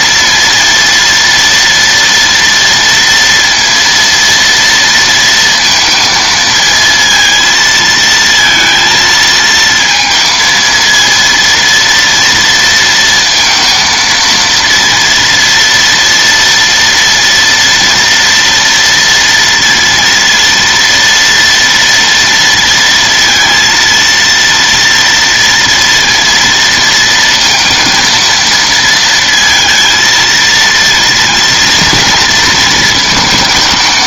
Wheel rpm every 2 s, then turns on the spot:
230, 230, 230, 220, 230, 230, 230, 230, 230, 230, 230, 230, 230, 230, 230, 230, 230.
none